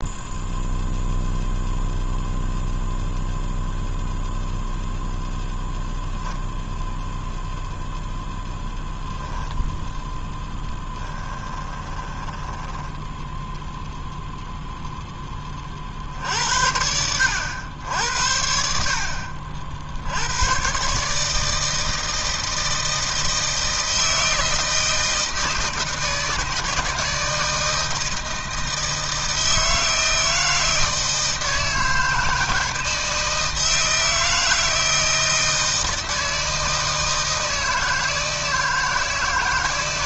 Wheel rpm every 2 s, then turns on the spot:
0, 0, 0, 0, 0, 10, 10, 0, 70, 70, 110, 160, 160, 160, 160, 160, 160, 160, 160, 160.
10-14